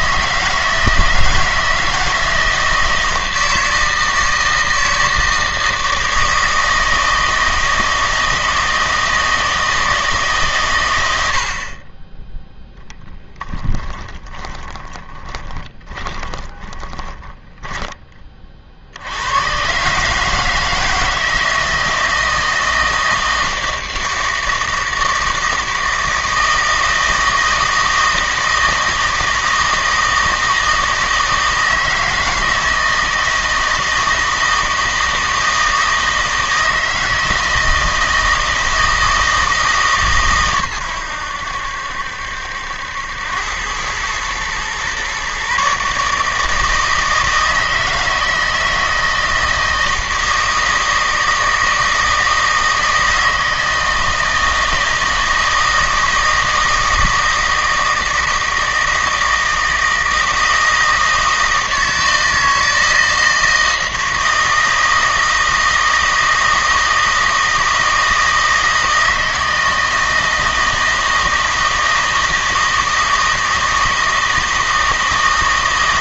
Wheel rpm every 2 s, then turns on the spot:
160, 160, 160, 160, 160, 110, 10, 30, 20, 60, 160, 160, 160, 160, 160, 160, 160, 160, 160, 160, 110, 80, 120, 160, 160, 160, 160, 160, 160, 160, 160, 160, 160, 160, 160, 160, 160, 160.
14-18